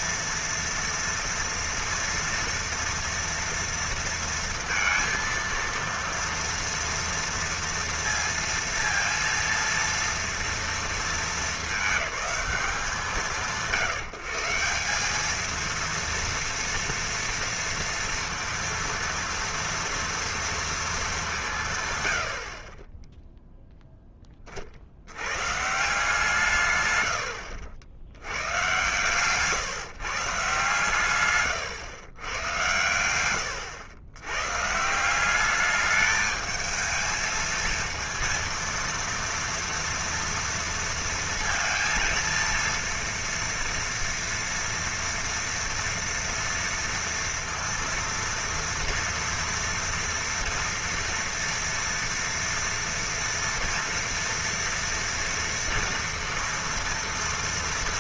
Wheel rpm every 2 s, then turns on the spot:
230, 230, 230, 230, 230, 230, 180, 180, 230, 230, 230, 40, 50, 130, 110, 140, 100, 140, 220, 230, 230, 230, 230, 230, 230, 230, 230, 230, 230.
none